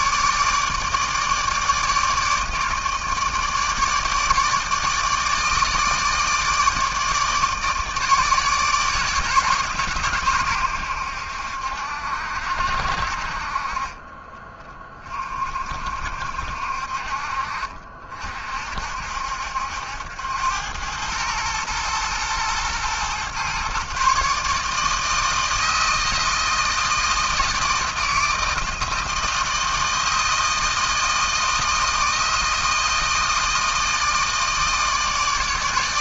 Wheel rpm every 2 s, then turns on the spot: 150, 160, 160, 150, 150, 110, 60, 20, 60, 50, 90, 120, 150, 160, 160, 160, 160, 160.
none